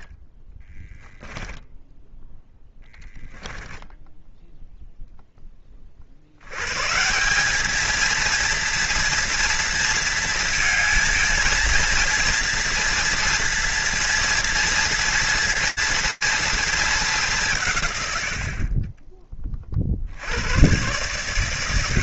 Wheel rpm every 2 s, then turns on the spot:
10, 0, 0, 160, 230, 230, 230, 240, 210, 30, 120.
0-2